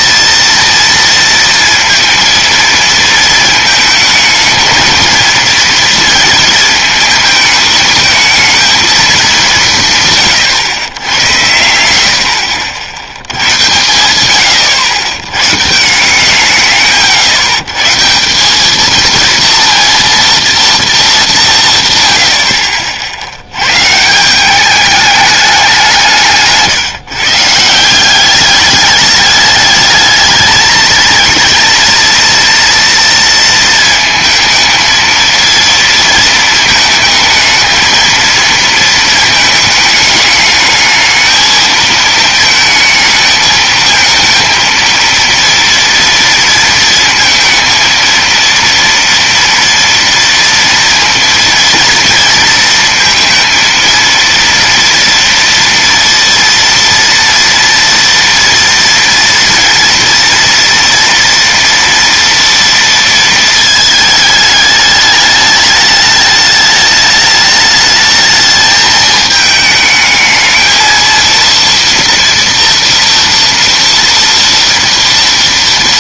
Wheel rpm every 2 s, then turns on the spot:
230, 230, 220, 220, 210, 100, 90, 110, 140, 230, 200, 70, 210, 150, 210, 220, 230, 230, 220, 220, 220, 220, 230, 230, 230, 230, 230, 230, 230, 230, 230, 230, 210, 210, 220, 230, 240, 230.
none